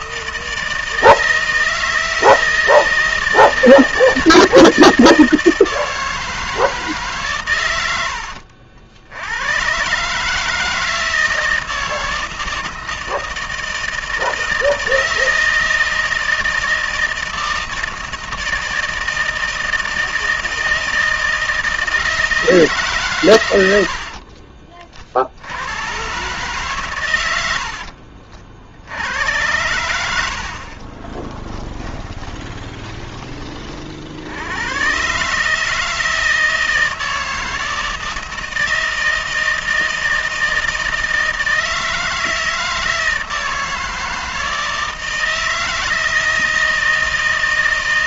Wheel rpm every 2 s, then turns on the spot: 160, 160, 160, 160, 70, 160, 160, 160, 160, 160, 160, 160, 40, 140, 50, 60, 20, 90, 160, 160, 160, 160, 160, 160.
32-34